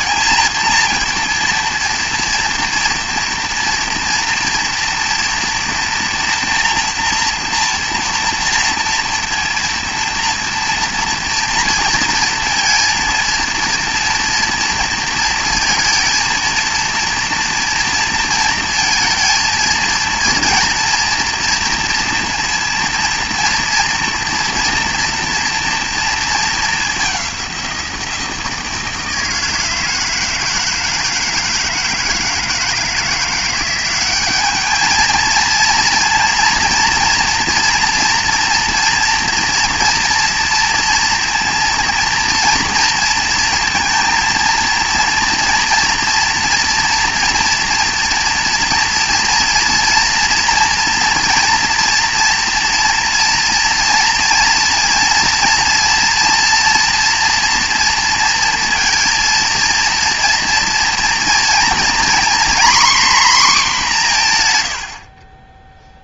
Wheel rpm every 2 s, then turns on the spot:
230, 230, 240, 240, 240, 240, 230, 230, 230, 230, 230, 230, 230, 210, 160, 160, 160, 210, 230, 230, 230, 230, 230, 230, 230, 230, 240, 230, 230, 230, 230, 260, 110.
none